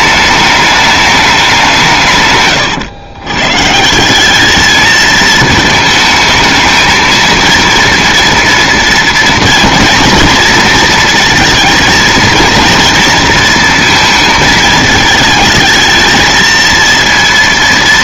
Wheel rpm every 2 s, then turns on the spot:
210, 120, 210, 220, 230, 230, 230, 220, 230.
none